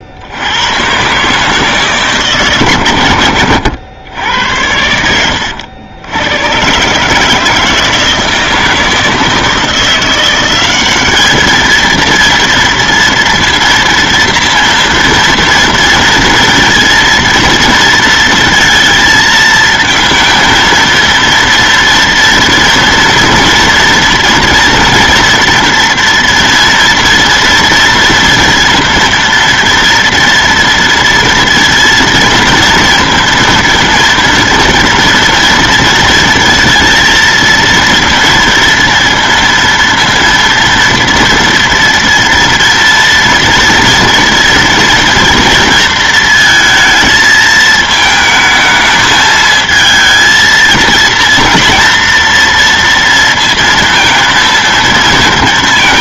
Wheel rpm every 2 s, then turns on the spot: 110, 130, 90, 120, 160, 190, 230, 230, 230, 230, 230, 230, 230, 230, 240, 230, 230, 230, 230, 230, 230, 230, 230, 220, 220, 230, 230, 230.
none